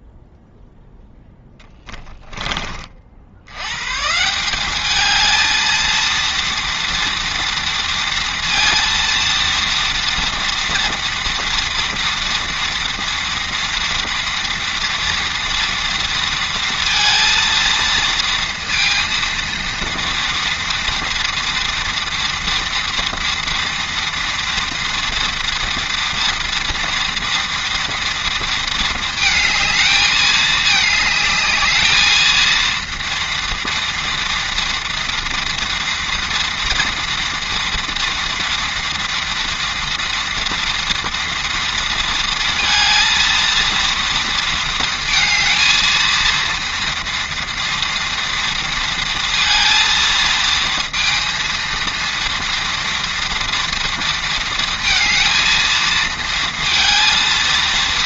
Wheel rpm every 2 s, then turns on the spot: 0, 20, 190, 230, 230, 240, 230, 230, 230, 230, 230, 230, 230, 230, 230, 220, 230, 230, 230, 230, 240, 230, 230, 230, 230, 230, 230, 230, 230.
none